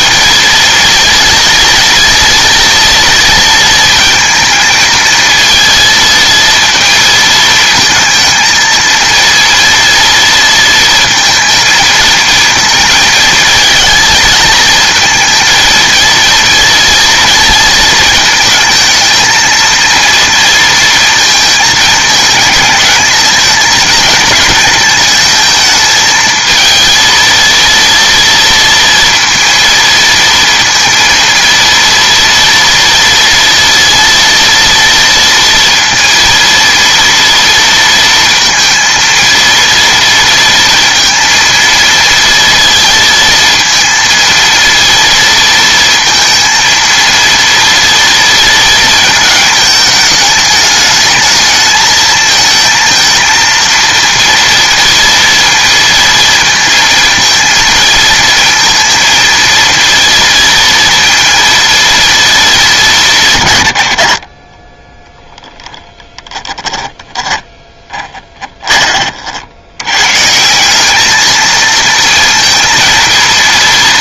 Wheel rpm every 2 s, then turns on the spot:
230, 230, 230, 230, 230, 230, 220, 230, 230, 220, 230, 220, 220, 230, 230, 230, 230, 230, 230, 230, 230, 230, 230, 230, 220, 210, 220, 230, 230, 230, 230, 210, 20, 10, 30, 190, 230.
66-68